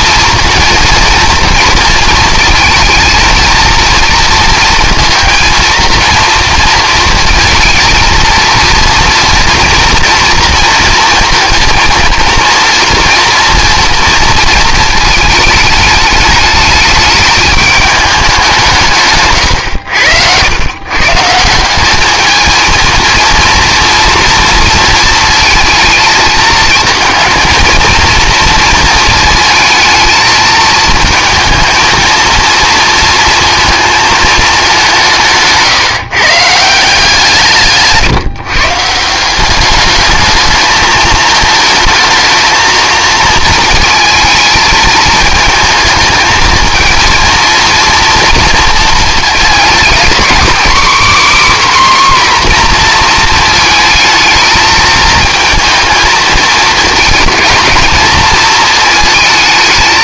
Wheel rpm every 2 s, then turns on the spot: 230, 230, 230, 230, 230, 230, 230, 220, 210, 180, 110, 230, 230, 220, 230, 230, 230, 200, 160, 140, 220, 220, 220, 220, 230, 270, 250, 220, 220, 230.
none